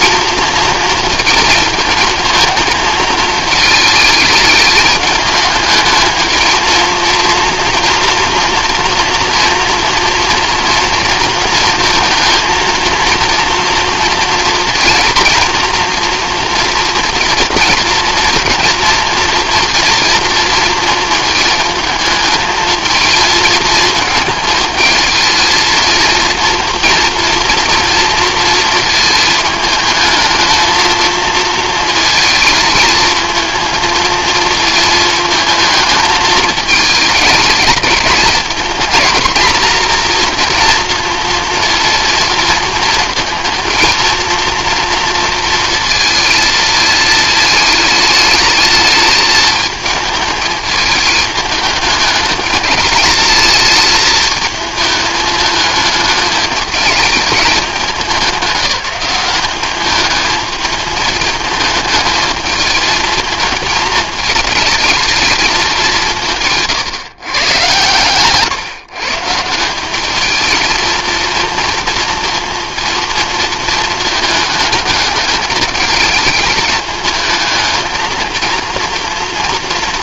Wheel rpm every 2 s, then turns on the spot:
220, 220, 210, 230, 230, 230, 230, 230, 230, 230, 220, 220, 220, 230, 220, 220, 220, 220, 220, 230, 230, 220, 230, 220, 220, 210, 210, 220, 210, 200, 210, 220, 220, 150, 140, 230, 230, 210, 210, 230.
none